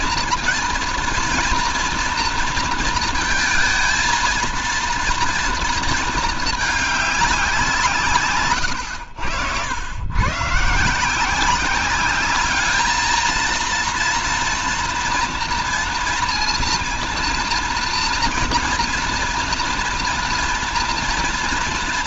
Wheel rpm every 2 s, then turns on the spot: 230, 230, 230, 210, 110, 150, 210, 230, 230, 240, 230.
none